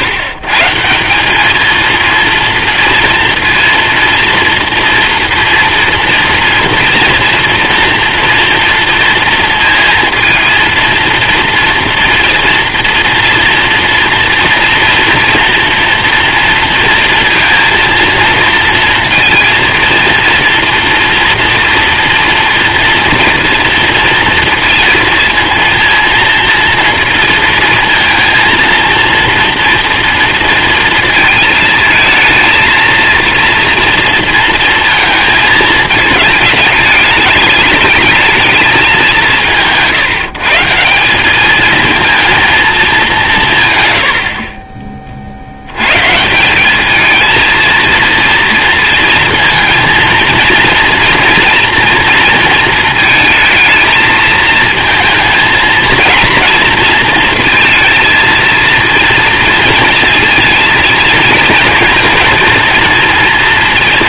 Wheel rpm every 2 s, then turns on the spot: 130, 230, 230, 230, 230, 230, 230, 230, 230, 230, 230, 230, 230, 230, 230, 230, 230, 230, 210, 210, 160, 220, 30, 190, 230, 230, 230, 230, 230, 230, 230, 220.
none